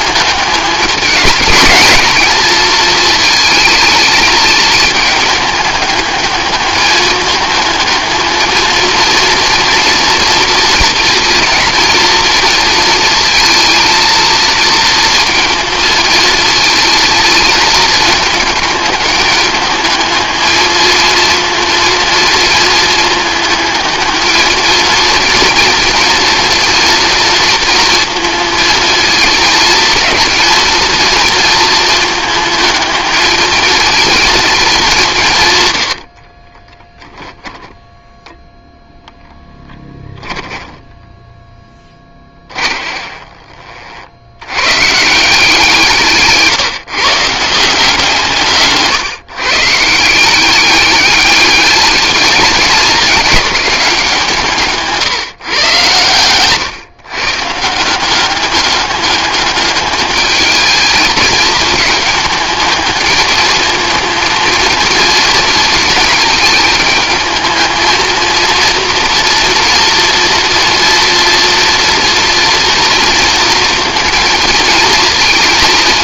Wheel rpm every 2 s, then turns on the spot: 200, 220, 210, 210, 230, 230, 230, 230, 230, 210, 220, 220, 230, 230, 230, 230, 220, 200, 10, 0, 10, 20, 140, 150, 140, 200, 200, 160, 130, 200, 220, 210, 220, 220, 230, 230, 230, 230.
36-38 40-44